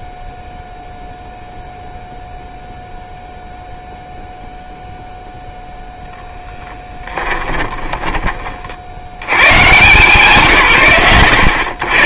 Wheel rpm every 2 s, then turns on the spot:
0, 0, 0, 10, 20, 110.
none